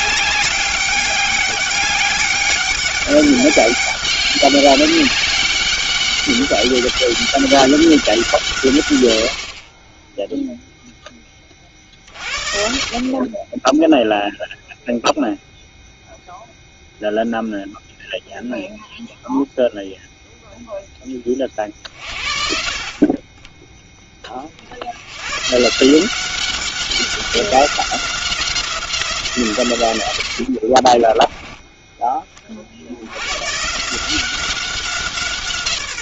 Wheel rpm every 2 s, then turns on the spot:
200, 200, 200, 200, 110, 0, 40, 0, 0, 0, 10, 40, 90, 190, 170, 30, 70, 180.
30-32